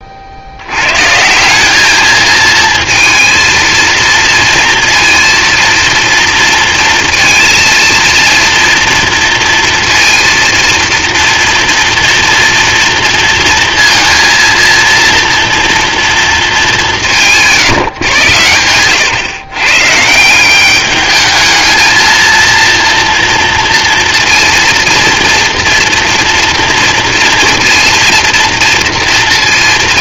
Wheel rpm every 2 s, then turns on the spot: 110, 230, 230, 230, 230, 230, 230, 230, 190, 110, 200, 230, 230, 230, 230.
none